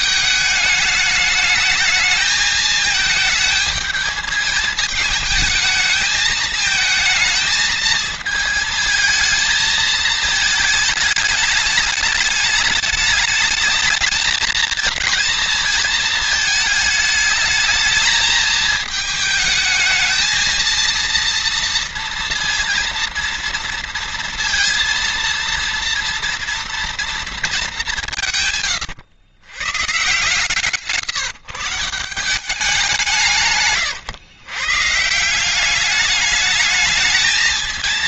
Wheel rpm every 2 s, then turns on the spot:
210, 220, 220, 220, 220, 210, 210, 220, 210, 220, 230, 230, 230, 230, 120, 140, 160, 150, 220.
none